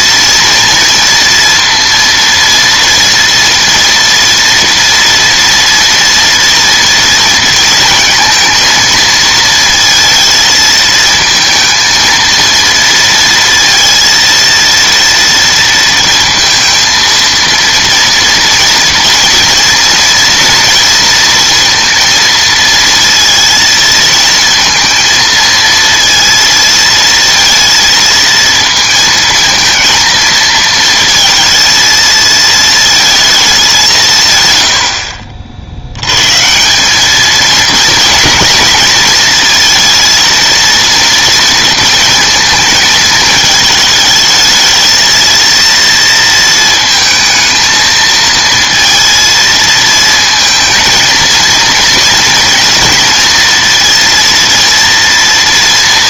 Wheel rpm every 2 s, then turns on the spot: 230, 230, 230, 230, 230, 220, 230, 230, 230, 230, 230, 230, 230, 230, 230, 220, 220, 110, 180, 220, 230, 220, 220, 220, 230, 220, 230, 230.
34-36